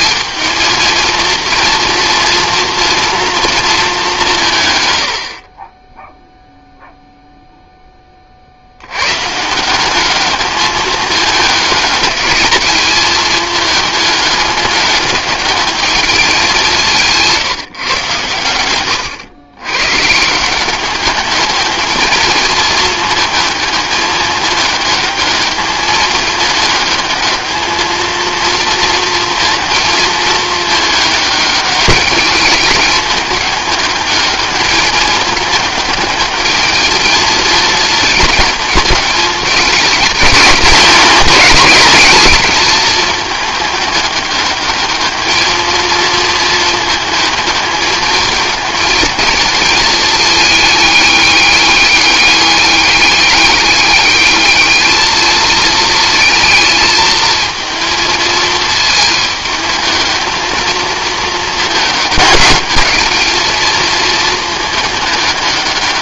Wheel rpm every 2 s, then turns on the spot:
220, 230, 130, 0, 80, 210, 220, 200, 190, 110, 190, 220, 210, 210, 230, 220, 210, 210, 220, 220, 200, 210, 210, 220, 220, 210, 200, 210, 220, 220, 220, 210, 210.
18-20